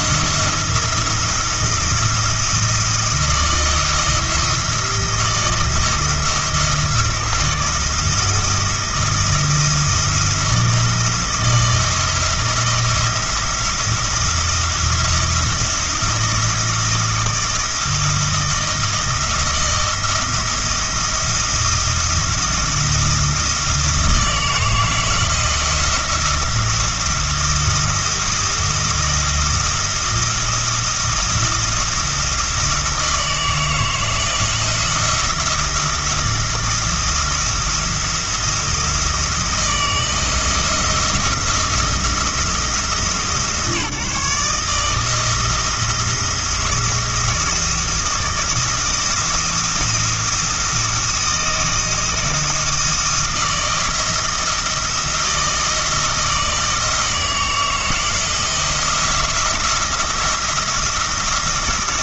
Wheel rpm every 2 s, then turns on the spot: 170, 170, 170, 160, 170, 160, 170, 170, 170, 170, 170, 170, 160, 170, 170, 170, 170, 170, 170, 160, 170, 160, 160, 170, 160, 170, 170, 170, 170, 170, 170.
none